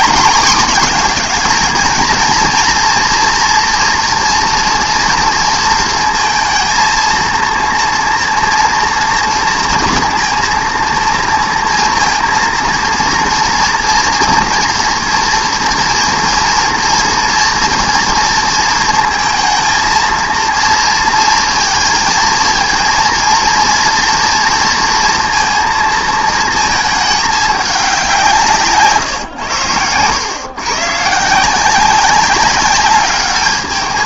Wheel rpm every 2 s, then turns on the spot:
220, 230, 230, 230, 230, 230, 230, 230, 230, 220, 230, 230, 230, 210, 130, 140, 200.
none